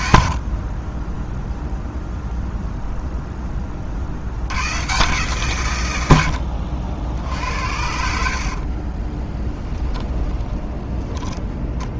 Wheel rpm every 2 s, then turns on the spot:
40, 0, 90, 70, 50, 20.
0-2 8-12